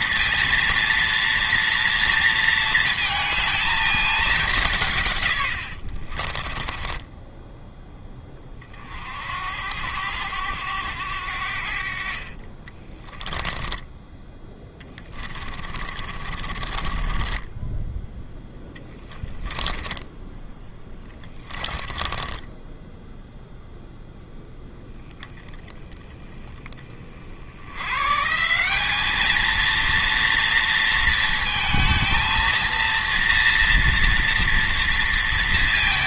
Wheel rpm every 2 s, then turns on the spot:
230, 230, 170, 20, 50, 90, 20, 10, 30, 20, 20, 10, 0, 20, 200, 230, 230, 230.
6-8 12-24